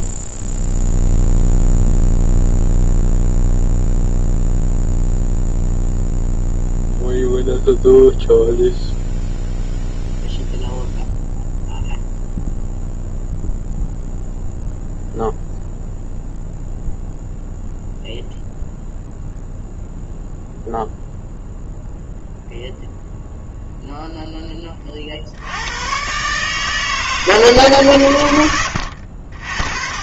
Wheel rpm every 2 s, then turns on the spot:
0, 0, 0, 0, 0, 0, 0, 0, 0, 0, 0, 0, 40, 150, 80.
none